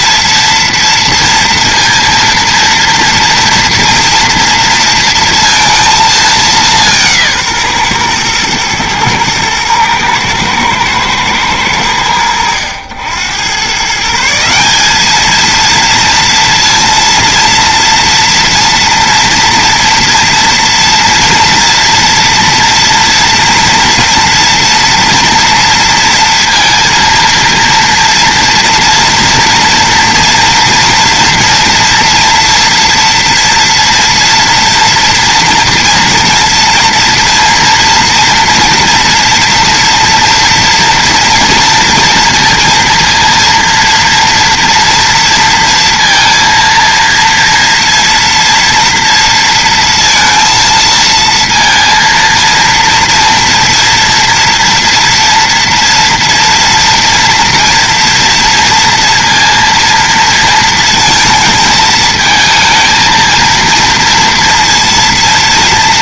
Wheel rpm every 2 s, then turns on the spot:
230, 230, 230, 190, 110, 110, 90, 190, 230, 240, 230, 230, 230, 230, 230, 230, 240, 230, 230, 230, 230, 230, 230, 230, 230, 230, 230, 230, 240, 230, 230, 220, 230.
none